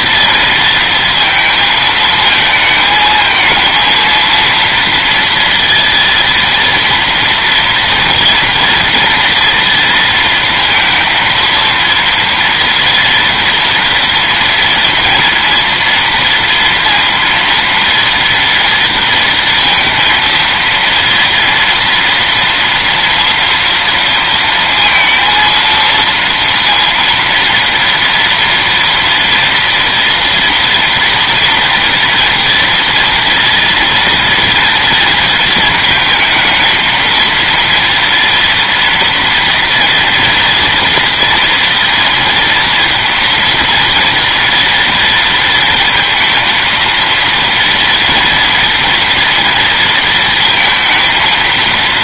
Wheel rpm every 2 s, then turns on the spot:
230, 220, 230, 230, 240, 230, 230, 240, 230, 230, 230, 230, 230, 230, 230, 230, 230, 230, 220, 230, 230, 230, 230, 230, 230, 230.
none